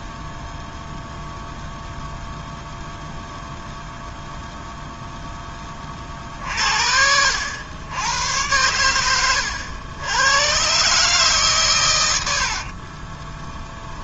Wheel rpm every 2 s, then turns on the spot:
0, 0, 0, 60, 100, 140, 50.
12-14